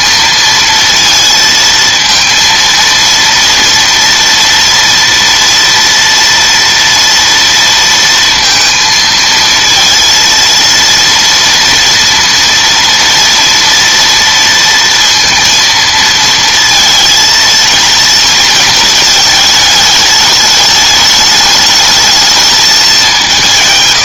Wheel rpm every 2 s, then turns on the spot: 230, 230, 230, 230, 230, 230, 230, 230, 230, 220, 210, 210.
none